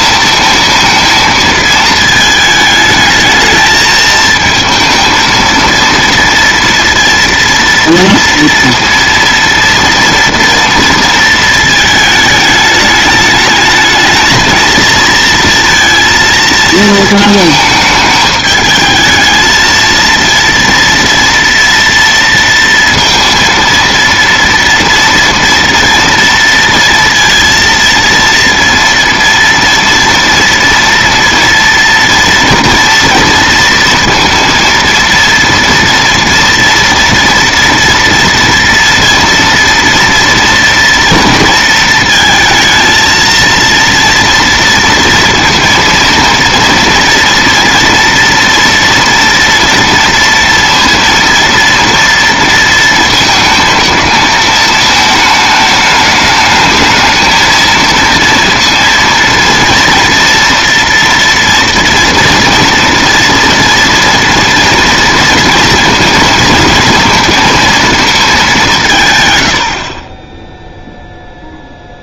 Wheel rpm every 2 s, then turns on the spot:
220, 220, 220, 230, 230, 230, 210, 220, 230, 210, 230, 230, 230, 230, 230, 230, 230, 230, 240, 230, 230, 230, 230, 230, 230, 230, 230, 220, 220, 230, 230, 230, 230, 220, 190, 0.
none